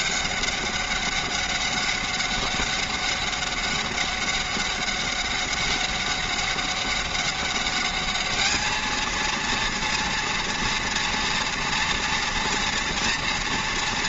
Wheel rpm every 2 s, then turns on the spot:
200, 200, 200, 190, 220, 230, 230.
none